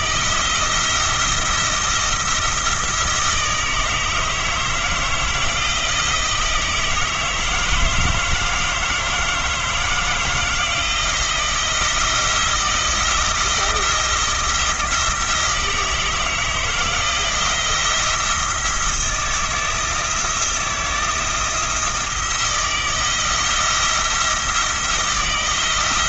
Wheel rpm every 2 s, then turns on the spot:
170, 160, 160, 160, 160, 160, 160, 170, 160, 170, 170, 160, 170.
none